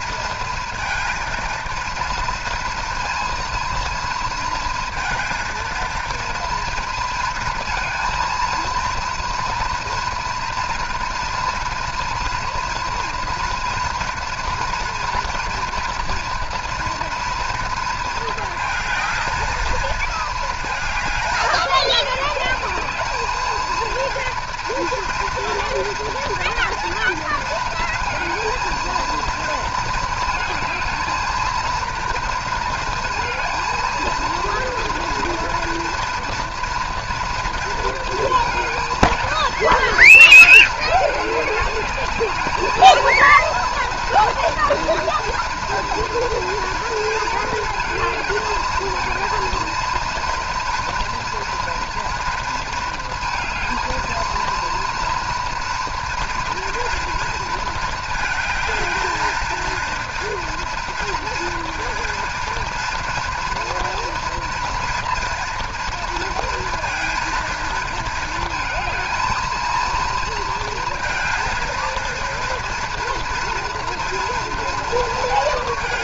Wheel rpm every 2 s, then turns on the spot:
230, 230, 230, 230, 230, 230, 240, 230, 230, 230, 220, 210, 230, 230, 230, 220, 230, 230, 230, 230, 220, 220, 230, 230, 220, 230, 230, 230, 240, 220, 230, 230, 230, 230, 230, 230, 230, 230.
none